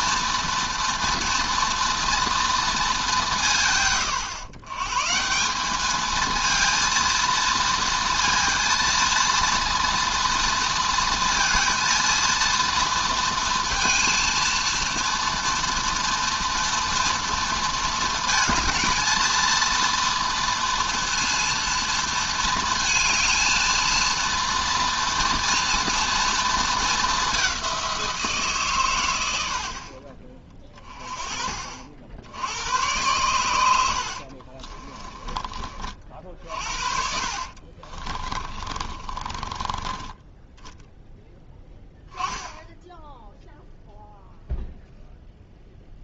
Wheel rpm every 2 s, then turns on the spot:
230, 220, 130, 230, 230, 230, 230, 230, 230, 220, 230, 220, 230, 220, 130, 30, 100, 30, 50, 30, 10, 10, 0.
34-36 38-40